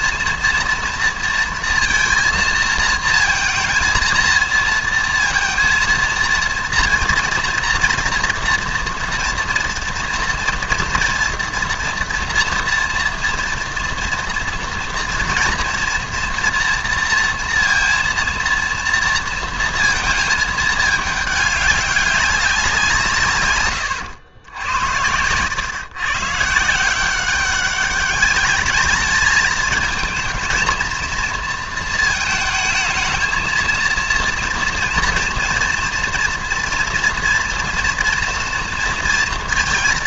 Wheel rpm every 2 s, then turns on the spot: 230, 230, 230, 230, 230, 230, 230, 230, 240, 230, 210, 190, 90, 160, 210, 230, 220, 230, 230, 230.
none